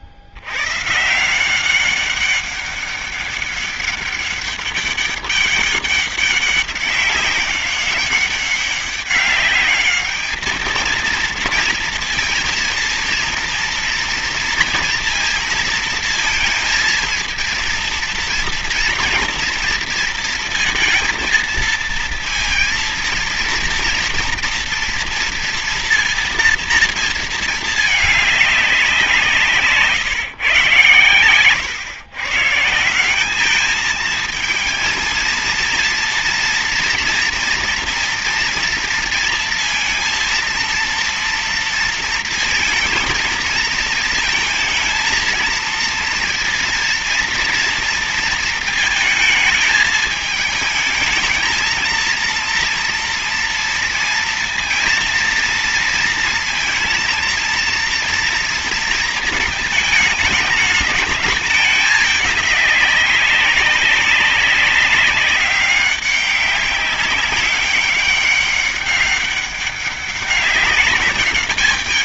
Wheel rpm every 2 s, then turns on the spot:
100, 200, 200, 200, 190, 220, 230, 230, 230, 230, 230, 230, 230, 230, 200, 130, 150, 220, 230, 230, 230, 230, 230, 230, 230, 220, 230, 230, 230, 230, 210, 200, 190, 190, 190, 200.
none